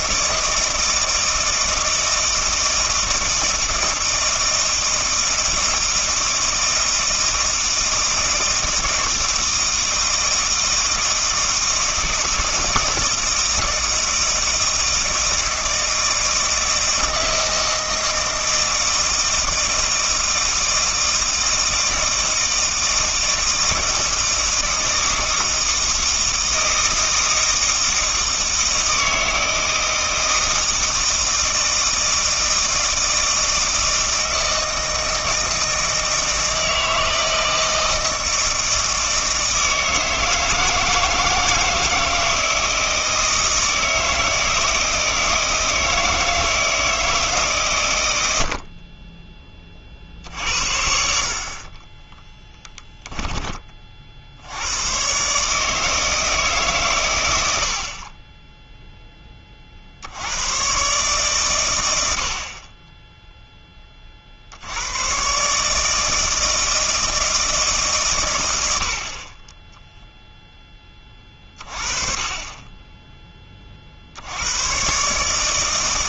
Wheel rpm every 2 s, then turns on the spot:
160, 160, 160, 160, 160, 160, 160, 160, 160, 160, 160, 160, 160, 160, 160, 160, 160, 160, 160, 160, 160, 160, 160, 160, 50, 70, 10, 100, 130, 0, 130, 20, 90, 160, 70, 10, 20, 120.
52-54